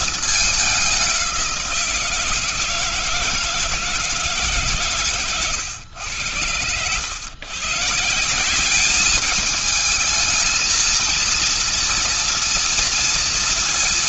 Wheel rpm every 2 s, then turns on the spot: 200, 170, 130, 100, 210, 230, 230.
none